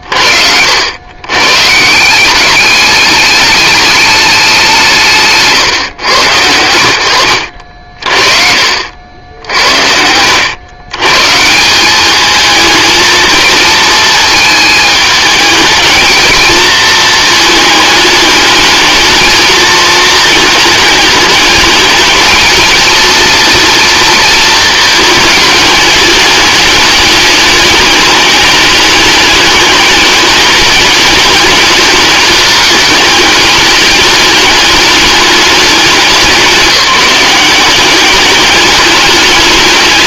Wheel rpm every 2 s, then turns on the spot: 120, 210, 160, 70, 80, 140, 220, 210, 220, 220, 210, 230, 220, 210, 210, 210, 210, 210, 190, 210.
none